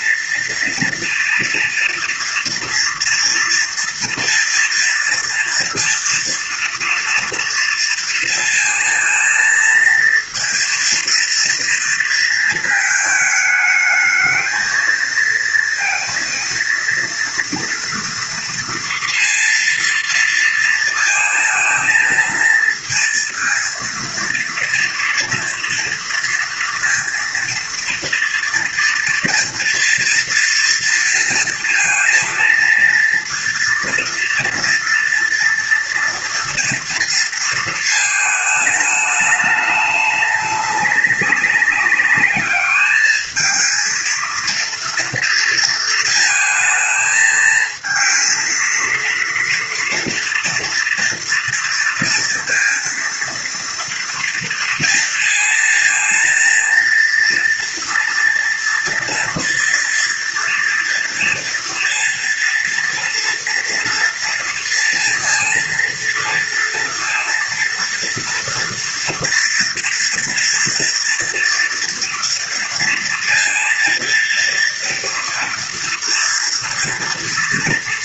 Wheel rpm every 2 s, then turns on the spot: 230, 230, 230, 230, 230, 230, 220, 220, 230, 230, 230, 230, 230, 230, 240, 230, 230, 240, 230, 210, 200, 210, 230, 220, 230, 230, 230, 230, 230, 230, 230, 240, 230, 230, 230, 230, 230, 230, 230.
none